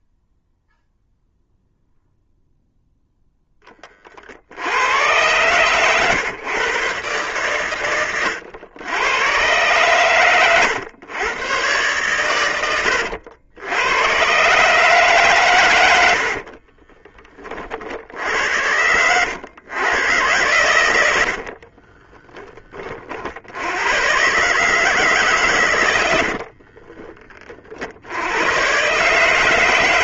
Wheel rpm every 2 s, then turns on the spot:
0, 0, 100, 120, 100, 120, 80, 140, 20, 90, 90, 40, 140, 20, 140.
20-22 26-28